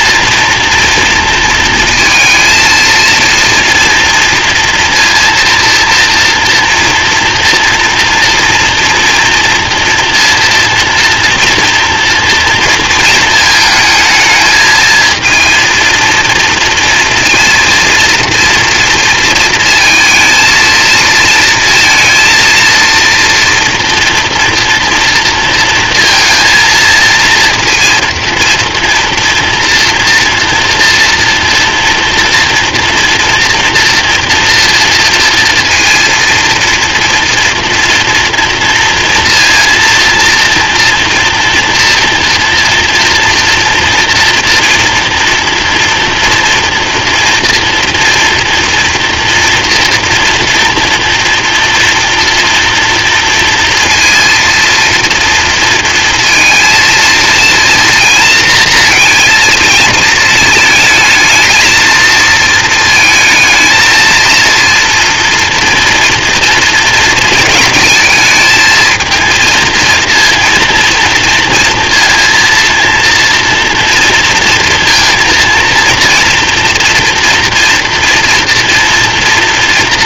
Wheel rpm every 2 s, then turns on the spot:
230, 230, 230, 230, 240, 230, 230, 220, 230, 230, 230, 230, 240, 230, 230, 230, 230, 230, 230, 230, 230, 230, 230, 240, 230, 230, 230, 230, 230, 230, 220, 220, 230, 230, 220, 230, 230, 230, 230, 230.
none